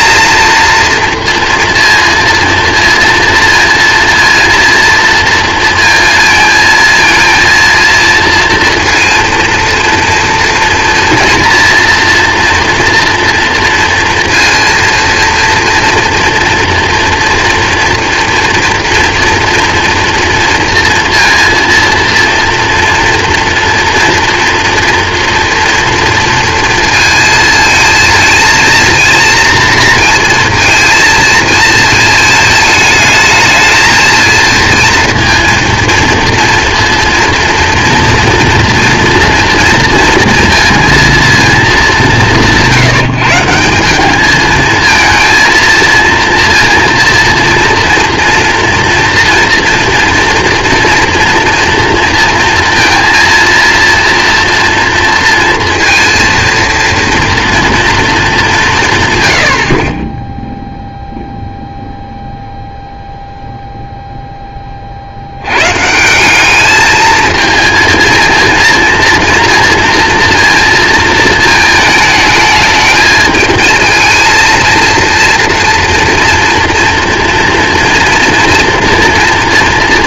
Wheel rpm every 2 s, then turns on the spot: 230, 230, 230, 230, 230, 230, 230, 230, 230, 230, 230, 230, 230, 230, 230, 230, 220, 230, 230, 240, 230, 170, 220, 230, 230, 240, 230, 230, 230, 180, 0, 0, 20, 210, 230, 230, 220, 230, 230, 230.
none